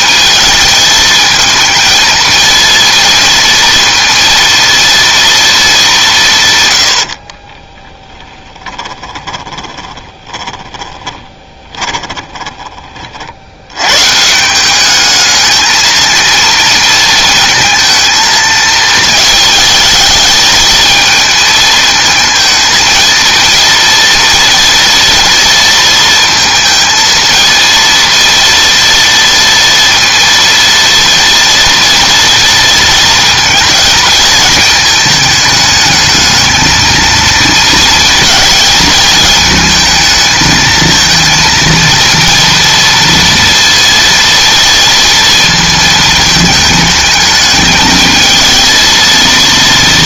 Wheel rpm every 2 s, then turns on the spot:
220, 230, 230, 120, 10, 20, 30, 190, 230, 220, 220, 220, 230, 230, 230, 230, 230, 220, 220, 220, 220, 230, 230, 220, 220.
8-12